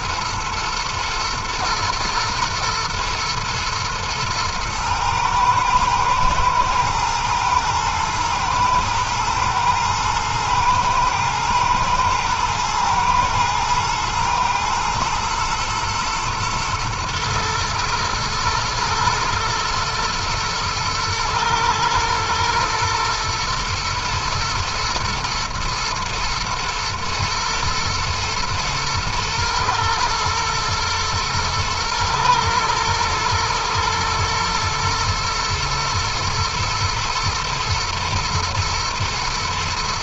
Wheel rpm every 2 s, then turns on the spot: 120, 120, 110, 110, 120, 110, 110, 110, 120, 110, 120, 120, 120, 120, 110, 110, 120, 120, 120, 120.
none